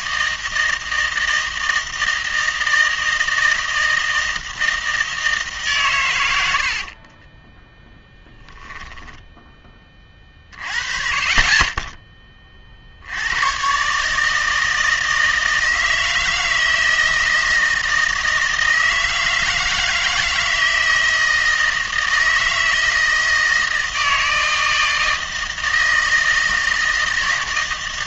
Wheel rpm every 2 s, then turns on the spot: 160, 160, 160, 50, 10, 30, 40, 160, 160, 160, 160, 160, 160, 160.
6-10